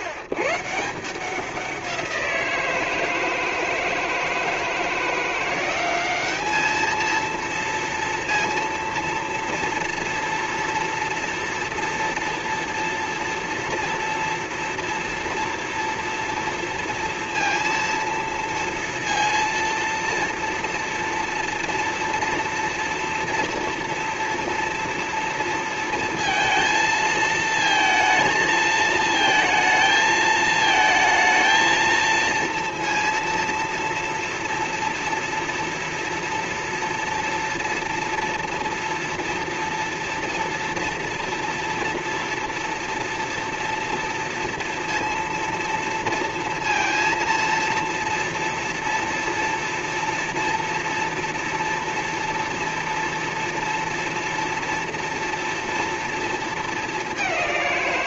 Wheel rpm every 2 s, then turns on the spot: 120, 170, 160, 210, 230, 230, 230, 230, 230, 230, 230, 240, 230, 230, 220, 220, 230, 230, 230, 230, 230, 230, 230, 230, 230, 230, 240, 230, 220.
none